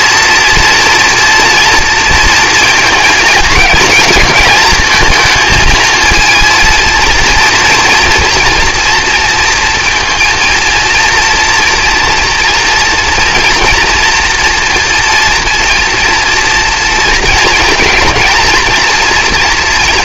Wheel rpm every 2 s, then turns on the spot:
230, 230, 220, 230, 230, 230, 230, 240, 230, 230.
none